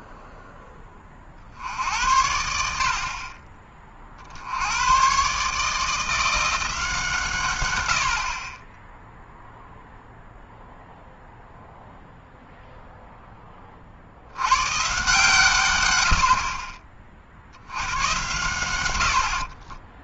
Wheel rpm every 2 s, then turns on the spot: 60, 20, 150, 110, 0, 0, 40, 120, 90, 20.
18-20